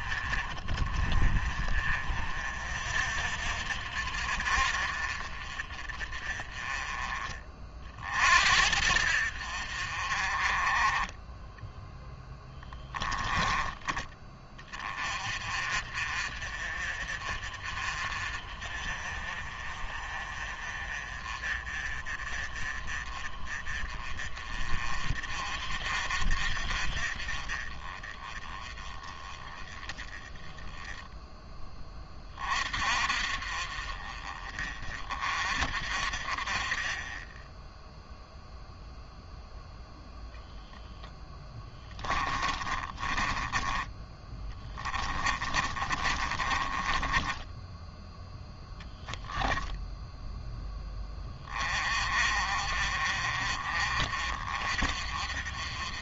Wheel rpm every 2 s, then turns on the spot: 50, 50, 50, 30, 70, 20, 20, 30, 40, 40, 40, 30, 40, 50, 30, 20, 40, 40, 20, 0, 0, 30, 30, 20, 10, 10, 50, 40.
10-14 42-48